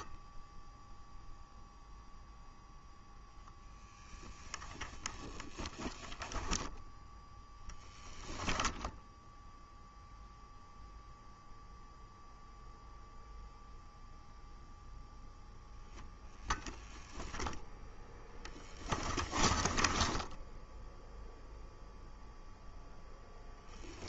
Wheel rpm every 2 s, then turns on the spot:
0, 0, 10, 0, 0, 0, 0, 0, 0, 10, 0, 0.
18-20